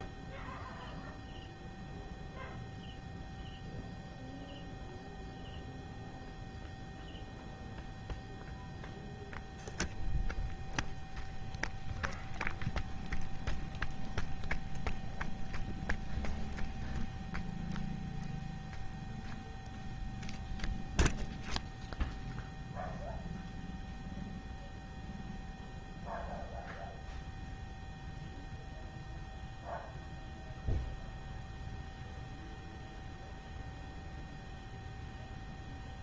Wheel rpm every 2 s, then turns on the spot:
0, 0, 0, 0, 0, 0, 0, 0, 0, 0, 0, 0, 0, 0, 0, 0, 0, 0.
none